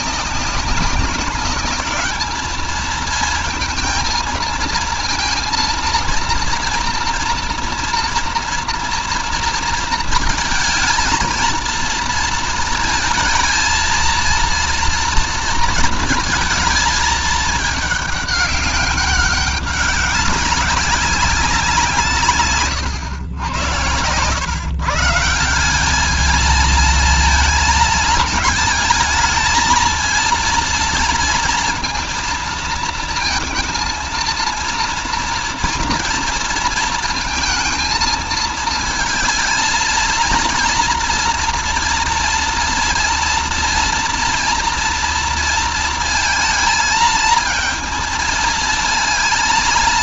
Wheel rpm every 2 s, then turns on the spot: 210, 230, 230, 230, 220, 230, 230, 230, 210, 190, 180, 110, 190, 220, 230, 230, 230, 230, 230, 230, 230, 230, 230, 220, 230.
none